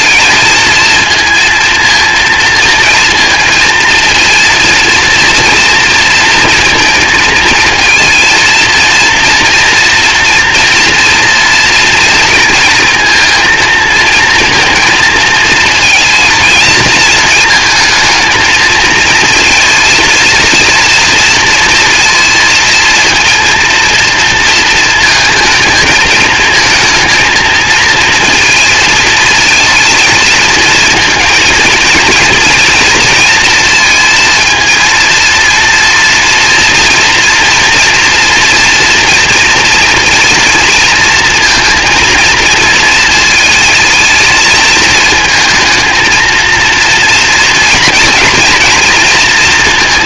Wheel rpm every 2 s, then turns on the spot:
220, 230, 230, 230, 230, 230, 230, 230, 230, 220, 230, 230, 230, 220, 230, 220, 230, 230, 230, 230, 230, 230, 220, 230, 240.
none